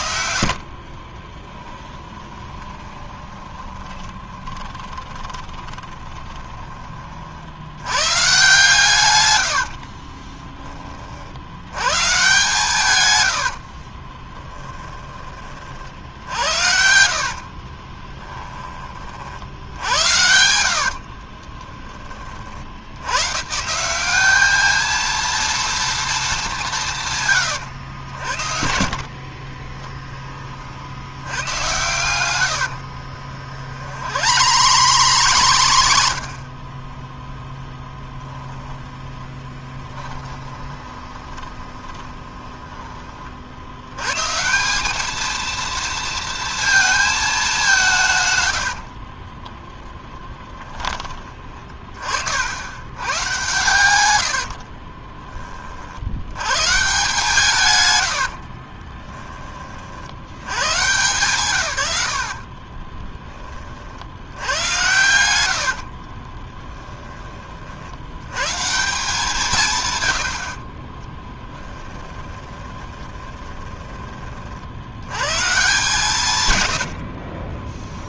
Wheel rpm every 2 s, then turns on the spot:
50, 20, 20, 30, 150, 40, 120, 20, 70, 30, 60, 80, 220, 150, 60, 70, 60, 120, 20, 20, 20, 30, 200, 220, 70, 30, 90, 40, 140, 30, 120, 20, 110, 10, 160, 30, 20, 80, 80.
2-6 14-18 20-22 28-30 32-36 38-42 48-52 54-56 58-60 62-66 70-74 76-78